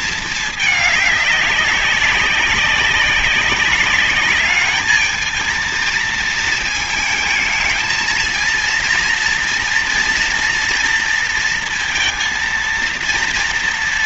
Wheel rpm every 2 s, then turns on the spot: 220, 190, 200, 220, 230, 230, 230.
none